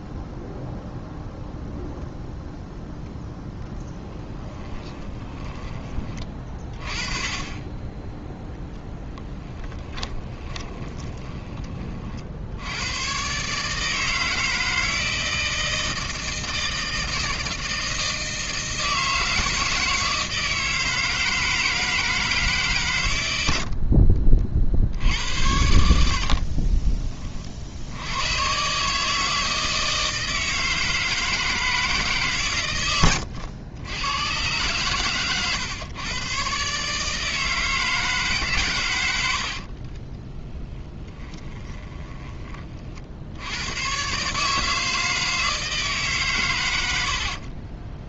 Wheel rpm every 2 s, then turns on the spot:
0, 0, 10, 30, 10, 20, 100, 160, 160, 160, 160, 130, 70, 30, 140, 160, 100, 120, 140, 120, 20, 50, 160, 90.
4-6 10-12 26-28 40-42